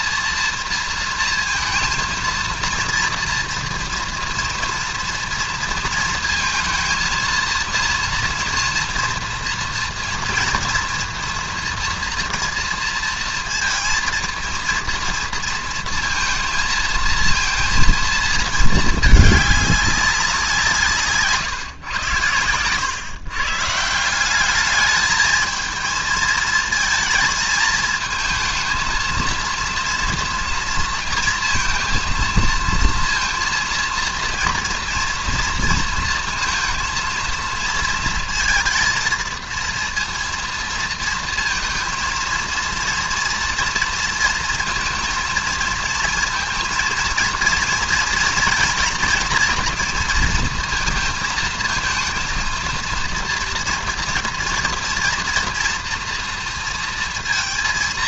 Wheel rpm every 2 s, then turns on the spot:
230, 230, 230, 220, 230, 230, 230, 230, 230, 220, 170, 110, 200, 230, 220, 230, 230, 230, 230, 230, 230, 230, 230, 220, 230, 230, 230, 230, 230.
none